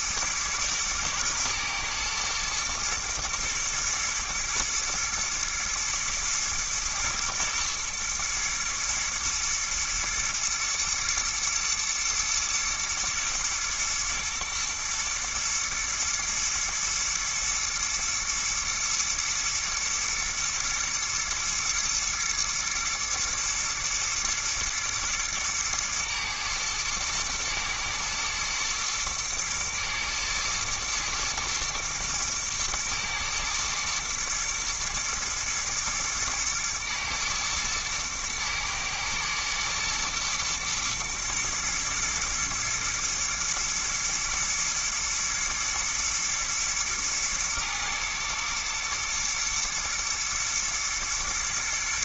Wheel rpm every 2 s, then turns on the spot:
120, 110, 120, 120, 110, 120, 120, 120, 120, 110, 120, 120, 110, 110, 120, 120, 110, 110, 120, 110, 120, 110, 110, 110, 110, 120.
none